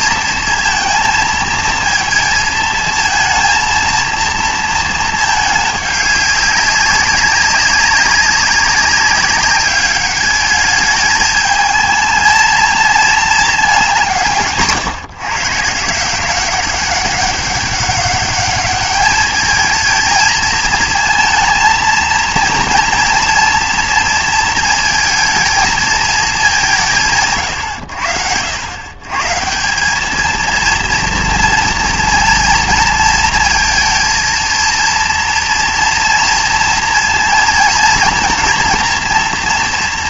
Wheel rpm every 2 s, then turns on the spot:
230, 220, 230, 200, 200, 210, 220, 150, 190, 210, 220, 230, 230, 190, 100, 230, 230, 230, 230, 230.
none